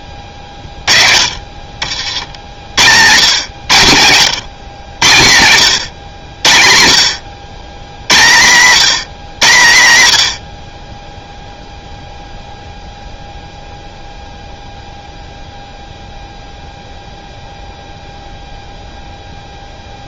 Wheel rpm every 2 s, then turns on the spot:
30, 70, 110, 70, 140, 60, 0, 0, 0, 0.
none